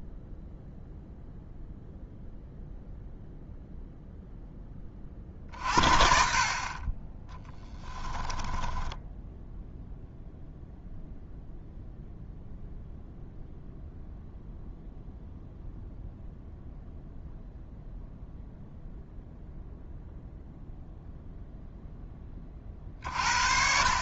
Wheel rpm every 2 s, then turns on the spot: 0, 0, 20, 30, 10, 0, 0, 0, 0, 0, 0, 50.
8-10